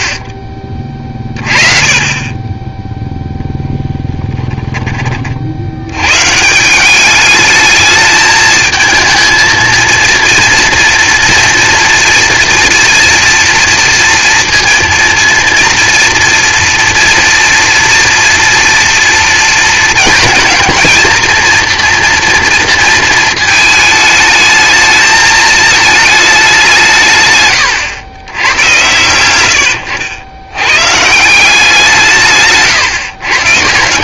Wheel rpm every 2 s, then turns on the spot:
30, 20, 10, 150, 220, 230, 230, 230, 230, 230, 220, 240, 220, 180, 110, 100, 160.
4-6